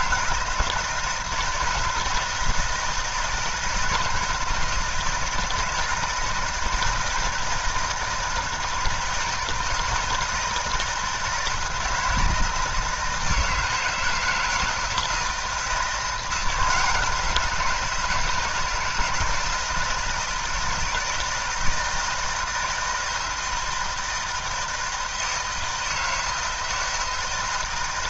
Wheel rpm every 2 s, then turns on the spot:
160, 170, 160, 160, 160, 160, 160, 170, 170, 160, 160, 160, 160, 160.
none